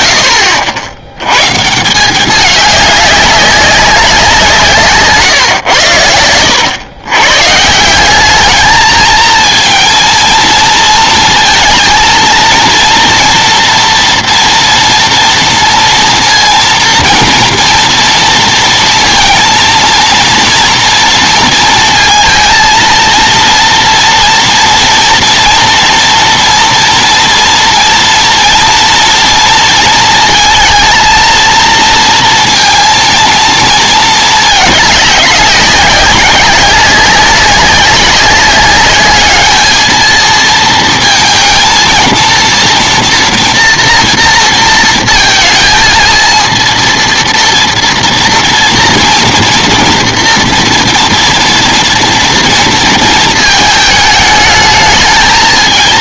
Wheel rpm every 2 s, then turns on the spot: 110, 200, 150, 110, 220, 230, 230, 240, 230, 230, 230, 230, 230, 230, 230, 220, 230, 210, 190, 200, 220, 230, 230, 230, 230, 230, 230, 220.
none